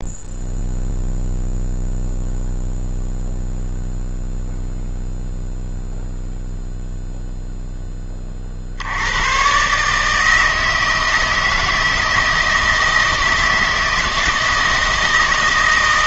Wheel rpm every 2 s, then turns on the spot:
0, 0, 0, 0, 70, 160, 160, 160.
none